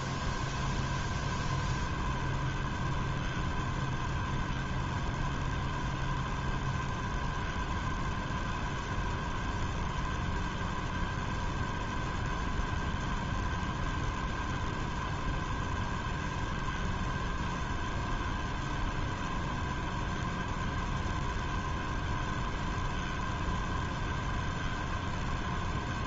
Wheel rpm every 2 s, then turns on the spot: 0, 0, 0, 0, 0, 0, 0, 0, 0, 0, 0, 0, 0.
none